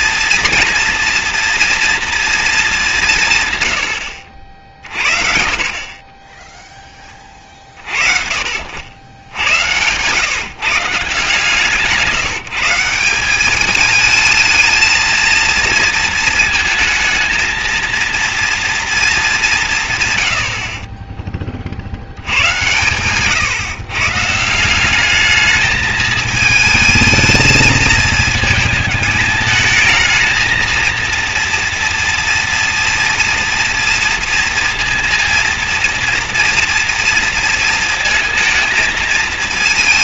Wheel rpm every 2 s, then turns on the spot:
230, 210, 50, 10, 60, 140, 160, 220, 230, 230, 60, 110, 160, 220, 220, 230, 230, 230, 230, 230.
none